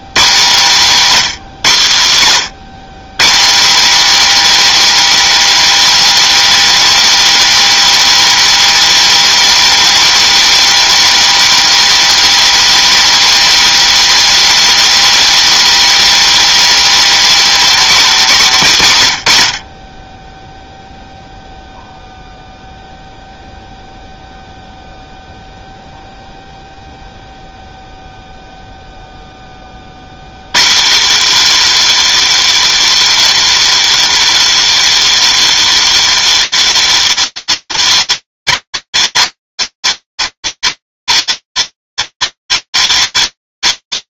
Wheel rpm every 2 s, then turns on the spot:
210, 200, 340, 340, 340, 340, 340, 340, 330, 100, 0, 0, 0, 0, 0, 240, 310, 310, 300, 190, 260, 310.
none